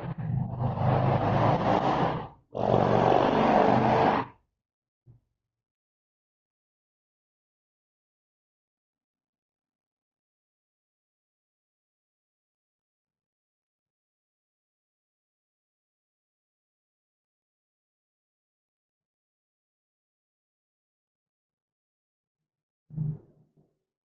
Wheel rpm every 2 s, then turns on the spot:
0, 0, 0, 0, 0, 0, 0, 0, 0, 0, 0, 0.
none